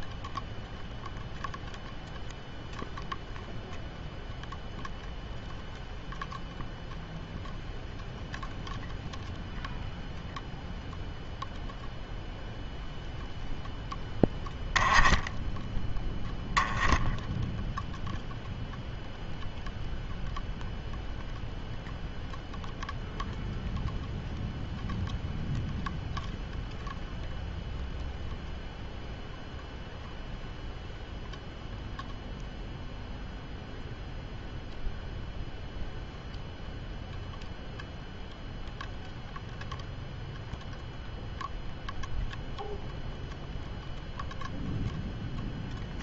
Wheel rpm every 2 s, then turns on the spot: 0, 0, 0, 0, 0, 0, 0, 10, 0, 0, 0, 0, 0, 0, 0, 0, 0, 0, 0, 0, 0, 0, 0.
none